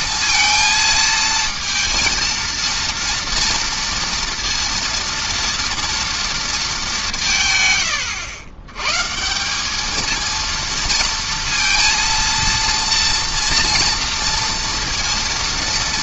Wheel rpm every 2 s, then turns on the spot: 230, 230, 230, 190, 130, 230, 230, 230.
none